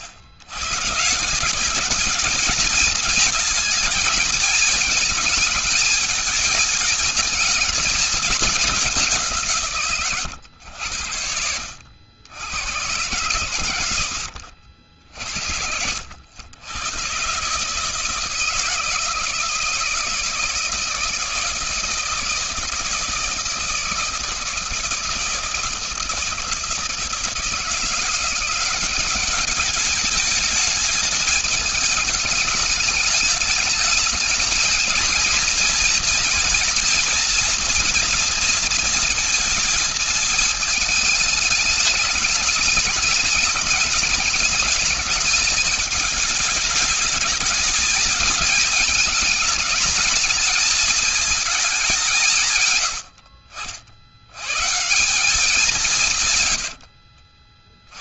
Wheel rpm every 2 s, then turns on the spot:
160, 220, 220, 220, 180, 80, 110, 60, 110, 160, 160, 160, 170, 160, 200, 210, 210, 230, 240, 230, 210, 210, 220, 220, 210, 220, 100, 150, 80.
none